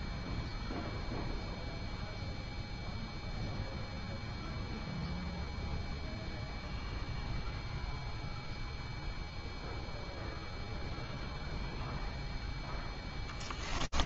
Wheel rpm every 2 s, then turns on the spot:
0, 0, 0, 0, 0, 0, 20.
12-14